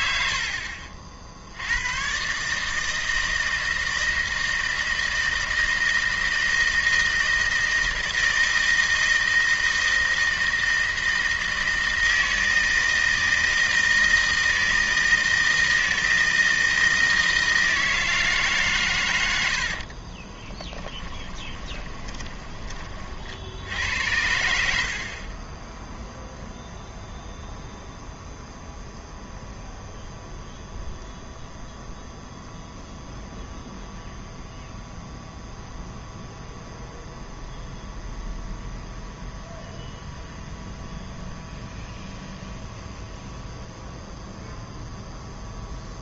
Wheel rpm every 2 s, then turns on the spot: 60, 150, 160, 160, 160, 160, 160, 160, 160, 130, 10, 30, 80, 0, 0, 0, 0, 0, 0, 0, 0, 0, 0.
20-22